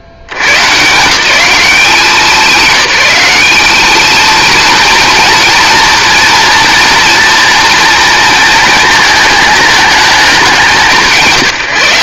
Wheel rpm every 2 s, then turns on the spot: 110, 190, 230, 230, 230, 190.
none